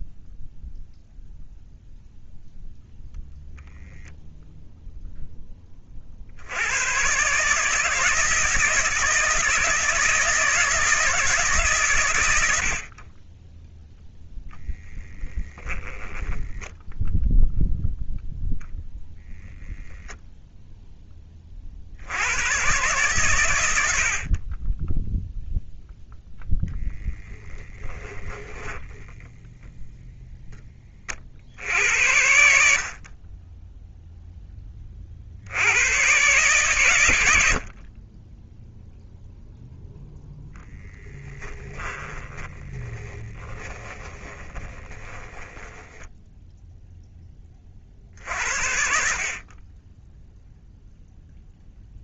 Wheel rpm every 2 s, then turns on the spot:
0, 0, 0, 110, 160, 160, 40, 10, 0, 10, 10, 130, 10, 10, 10, 30, 60, 40, 120, 0, 10, 20, 20, 0, 60, 0.
26-30 40-46